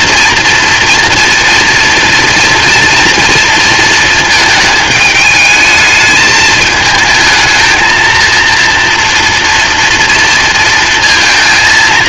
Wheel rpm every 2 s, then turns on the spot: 230, 230, 220, 220, 230, 230.
none